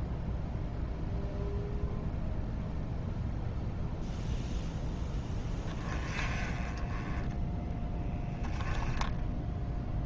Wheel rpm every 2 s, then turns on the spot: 0, 0, 0, 20, 10.
8-10